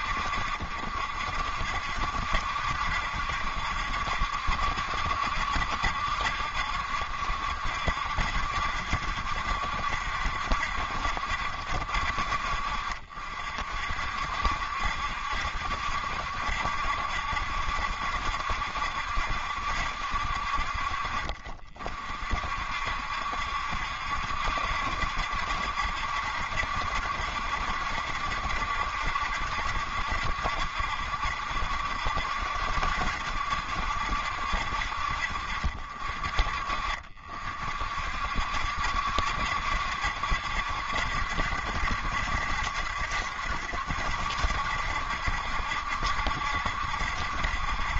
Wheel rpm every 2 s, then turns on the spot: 60, 70, 70, 60, 70, 60, 50, 60, 70, 70, 50, 50, 70, 70, 70, 70, 70, 60, 50, 60, 70, 70, 70, 70.
none